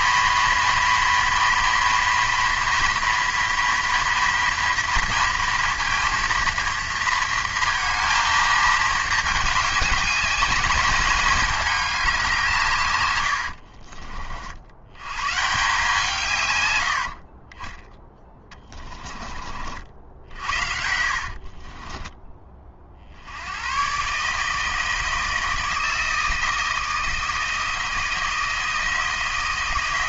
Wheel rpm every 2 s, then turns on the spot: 230, 240, 240, 230, 220, 210, 140, 80, 100, 20, 60, 40, 160, 160, 170.
18-22